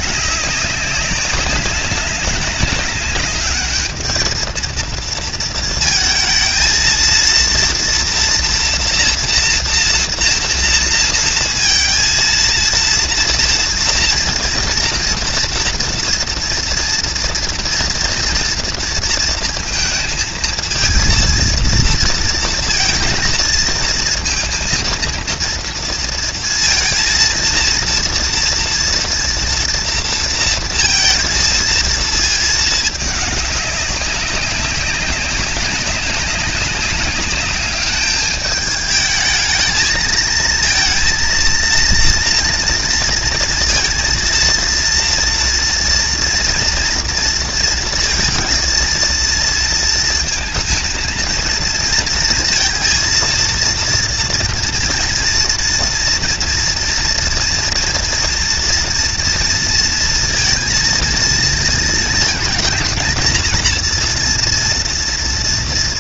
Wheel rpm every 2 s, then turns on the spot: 190, 200, 230, 230, 230, 230, 230, 230, 230, 230, 230, 230, 230, 230, 240, 230, 210, 190, 190, 210, 230, 230, 230, 230, 230, 230, 230, 230, 230, 230, 230, 220, 230.
none